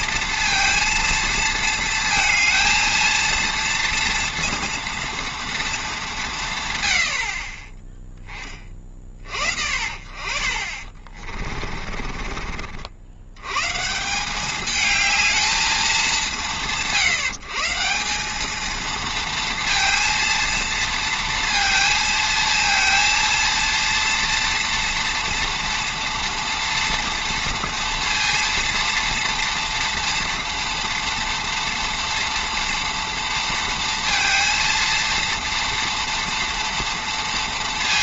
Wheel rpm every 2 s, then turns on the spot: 230, 230, 230, 120, 30, 40, 60, 210, 120, 220, 230, 230, 230, 230, 230, 240, 230, 230, 230.
10-12